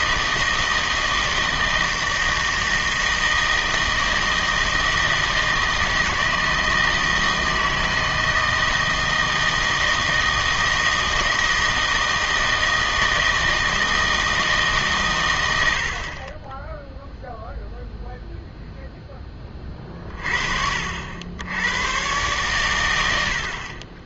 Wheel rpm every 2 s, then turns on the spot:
160, 160, 160, 160, 160, 160, 160, 150, 10, 0, 40, 110.
none